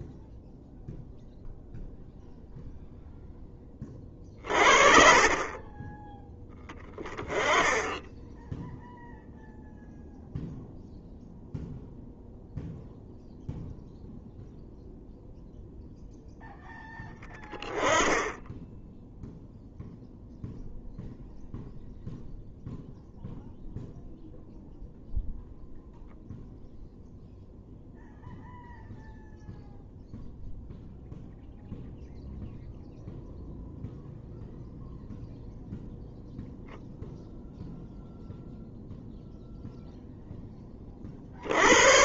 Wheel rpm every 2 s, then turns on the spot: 0, 0, 40, 10, 0, 0, 0, 0, 10, 10, 0, 0, 0, 0, 0, 0, 0, 0, 0, 0, 30.
none